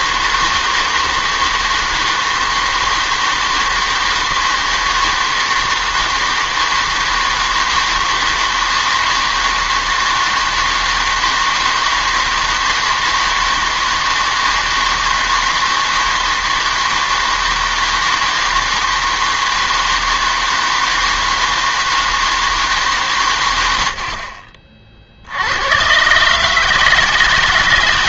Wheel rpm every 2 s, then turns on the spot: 160, 160, 160, 160, 160, 160, 160, 160, 160, 160, 160, 150, 40, 160.
none